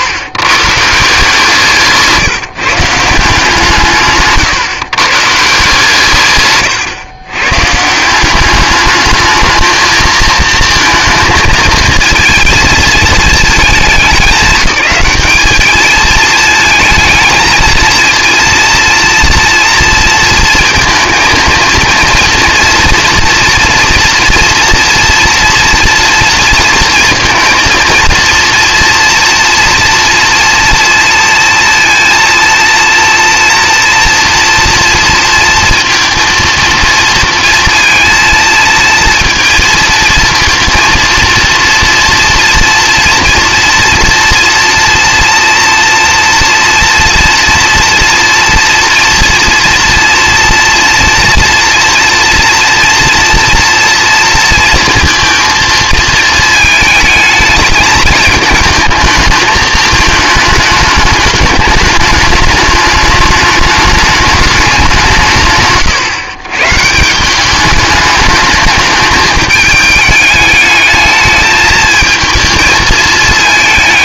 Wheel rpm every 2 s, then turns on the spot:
150, 150, 130, 130, 210, 230, 230, 200, 220, 230, 230, 230, 240, 230, 230, 230, 230, 230, 230, 230, 230, 240, 230, 240, 230, 230, 230, 230, 220, 220, 210, 210, 200, 140, 210, 210, 220.
none